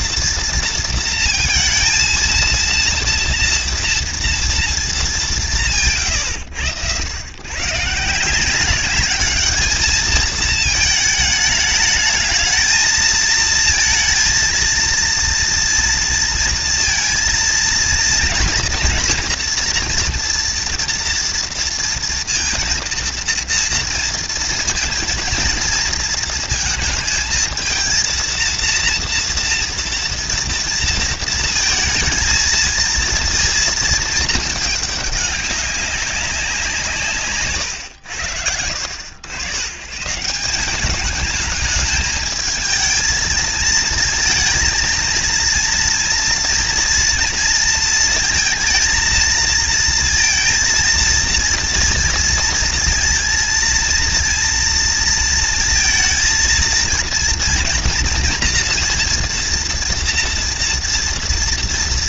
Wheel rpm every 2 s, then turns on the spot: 230, 230, 230, 100, 190, 220, 220, 230, 230, 230, 230, 230, 230, 230, 230, 230, 230, 210, 170, 80, 190, 220, 230, 230, 230, 230, 230, 230, 230, 230, 230.
none